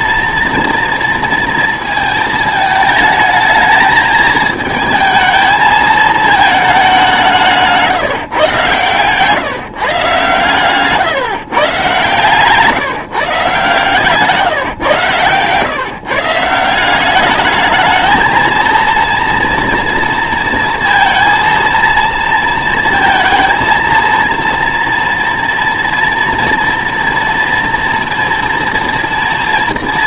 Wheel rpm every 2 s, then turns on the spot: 240, 220, 220, 210, 140, 130, 160, 140, 170, 230, 230, 230, 230, 230, 230.
10-12